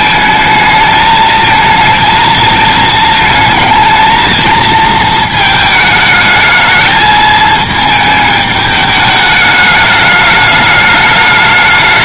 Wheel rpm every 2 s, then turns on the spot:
220, 220, 230, 220, 210, 210.
none